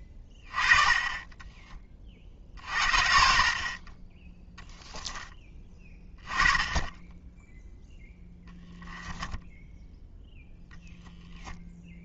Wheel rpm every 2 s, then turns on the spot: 20, 60, 10, 20, 10, 0.
8-10